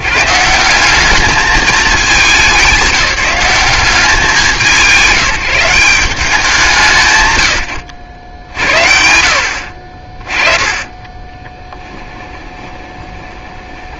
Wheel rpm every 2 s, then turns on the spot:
170, 200, 170, 170, 70, 30, 20.
10-14